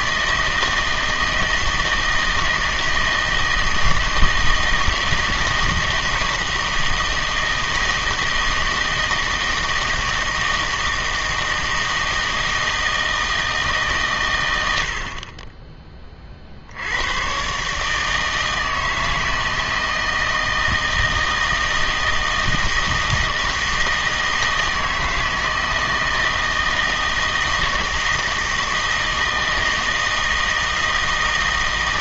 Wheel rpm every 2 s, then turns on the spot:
160, 160, 160, 160, 160, 160, 160, 100, 60, 160, 160, 160, 160, 160, 160, 160.
none